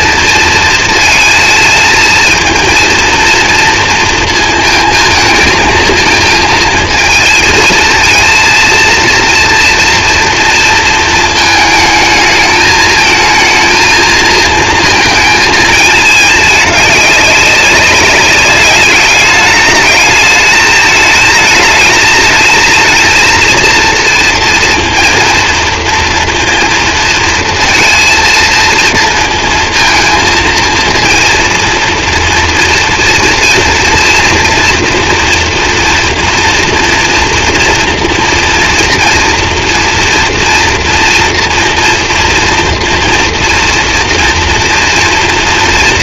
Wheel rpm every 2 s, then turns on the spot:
230, 230, 230, 220, 230, 230, 220, 230, 210, 200, 220, 220, 230, 230, 230, 230, 240, 230, 230, 230, 230, 230, 240.
none